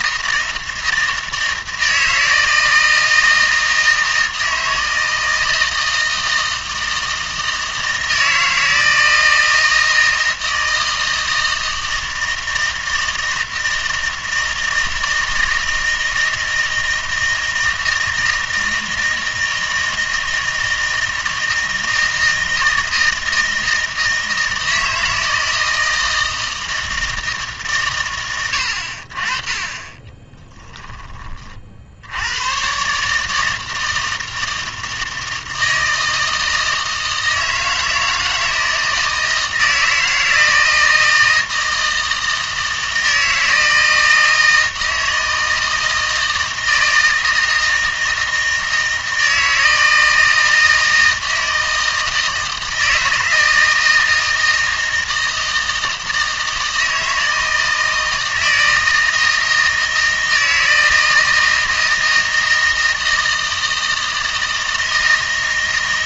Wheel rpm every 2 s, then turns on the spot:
160, 160, 160, 160, 160, 160, 160, 160, 160, 160, 160, 160, 160, 160, 70, 10, 130, 160, 160, 160, 160, 160, 160, 160, 160, 160, 160, 160, 160, 160, 160, 160, 160.
none